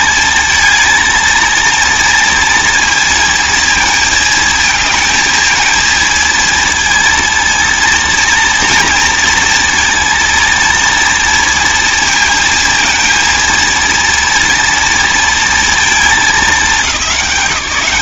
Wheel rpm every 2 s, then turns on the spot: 230, 230, 230, 230, 230, 230, 230, 230, 210.
none